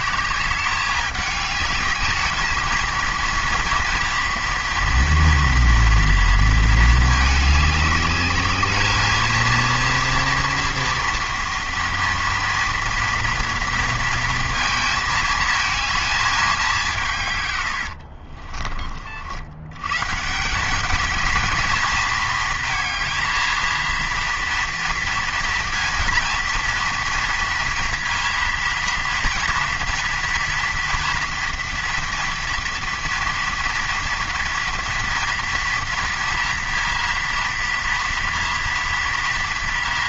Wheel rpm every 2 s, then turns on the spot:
200, 230, 230, 220, 210, 230, 230, 230, 190, 40, 180, 230, 230, 240, 230, 230, 230, 230, 230, 230.
none